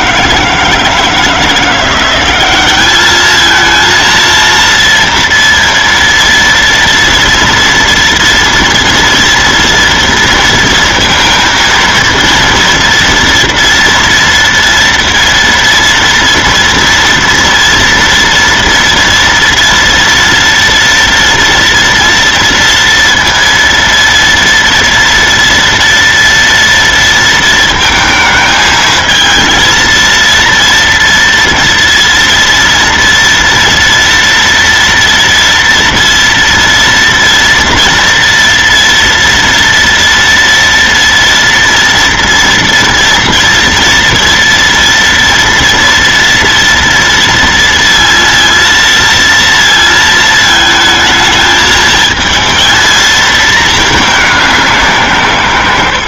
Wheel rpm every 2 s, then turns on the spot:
160, 200, 230, 230, 230, 230, 230, 230, 230, 230, 230, 230, 230, 230, 220, 230, 230, 240, 230, 230, 230, 230, 230, 230, 230, 220, 230, 180.
none